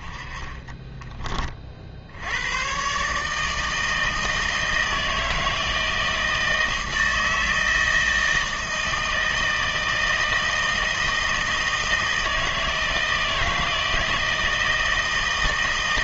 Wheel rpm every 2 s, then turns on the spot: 20, 110, 160, 160, 160, 160, 160, 160.
0-2